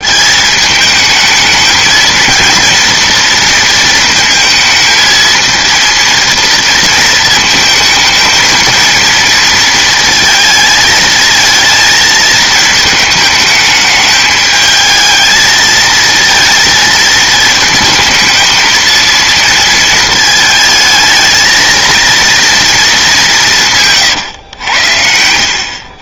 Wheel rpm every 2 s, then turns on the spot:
220, 230, 220, 230, 230, 220, 210, 220, 220, 230, 220, 200, 90.
none